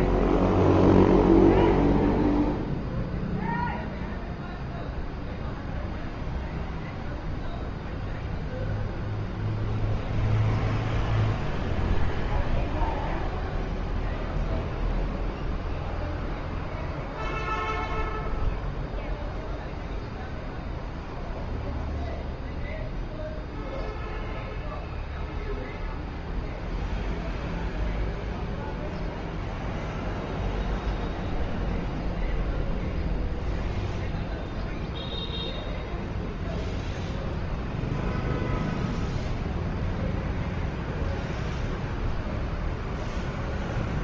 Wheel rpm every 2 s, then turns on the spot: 0, 0, 0, 0, 0, 0, 0, 0, 0, 0, 0, 0, 0, 0, 0, 0, 0, 0, 0, 0, 0, 0.
none